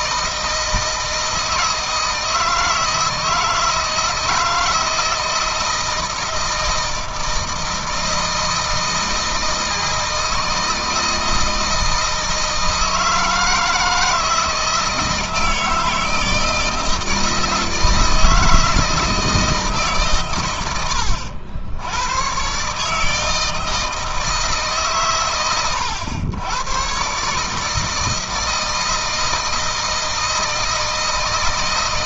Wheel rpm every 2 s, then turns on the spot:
160, 160, 160, 160, 160, 160, 160, 160, 160, 160, 90, 130, 150, 110, 160, 160.
none